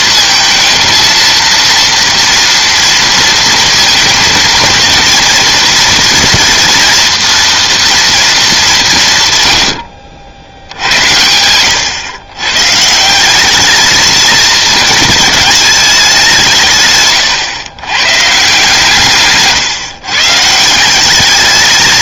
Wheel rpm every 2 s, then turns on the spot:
220, 230, 230, 230, 170, 90, 150, 220, 140, 140, 170.
16-18